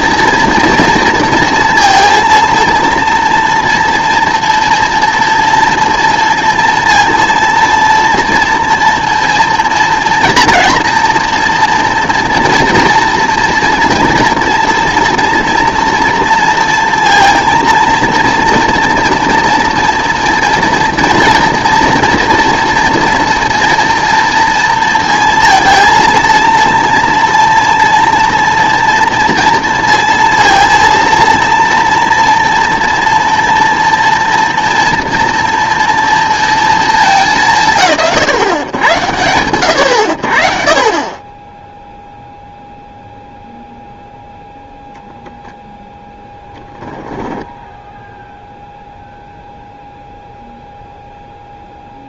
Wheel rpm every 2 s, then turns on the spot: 230, 230, 230, 230, 230, 240, 230, 230, 230, 230, 240, 230, 230, 230, 230, 230, 230, 230, 220, 120, 50, 0, 0, 10, 0, 0.
46-48